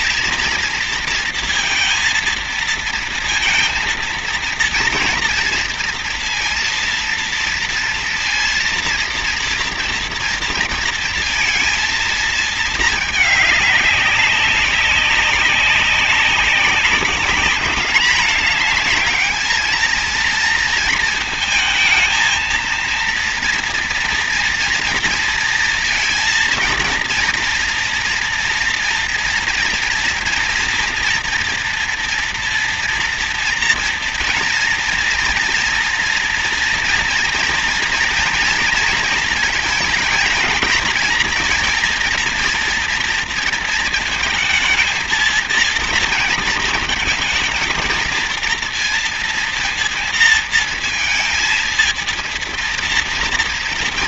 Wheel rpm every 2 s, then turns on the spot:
230, 230, 230, 230, 230, 230, 220, 200, 200, 220, 230, 230, 230, 230, 230, 230, 230, 230, 230, 230, 230, 230, 230, 220, 230, 230, 230.
none